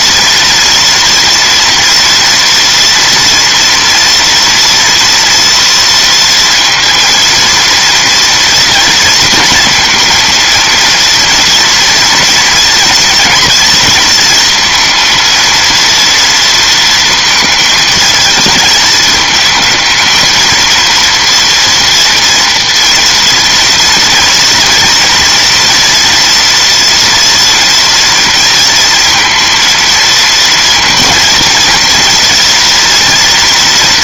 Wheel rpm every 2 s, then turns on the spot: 230, 230, 230, 230, 230, 230, 230, 230, 230, 220, 230, 230, 230, 230, 230, 230, 240.
none